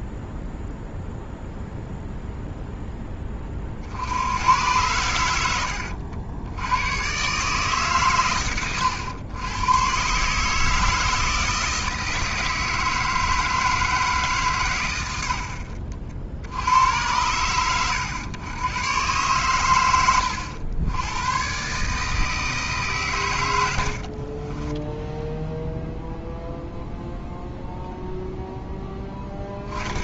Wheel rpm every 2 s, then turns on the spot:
0, 0, 100, 100, 110, 150, 160, 130, 80, 100, 90, 150, 20, 0, 0.
24-26